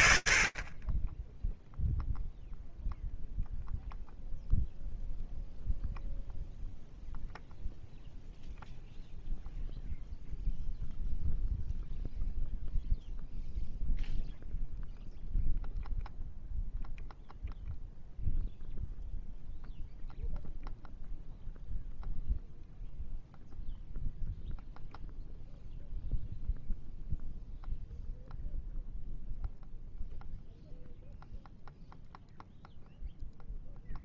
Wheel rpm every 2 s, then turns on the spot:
30, 0, 0, 0, 0, 0, 0, 0, 0, 0, 0, 0, 0, 0, 0, 0, 0.
none